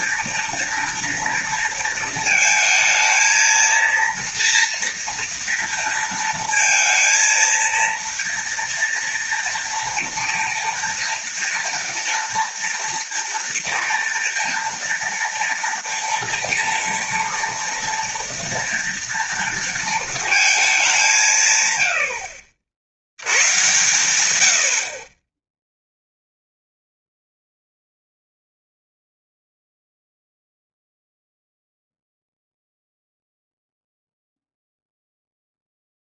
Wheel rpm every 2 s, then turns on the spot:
240, 220, 230, 230, 230, 240, 230, 230, 230, 230, 210, 80, 90, 0, 0, 0, 0, 0.
none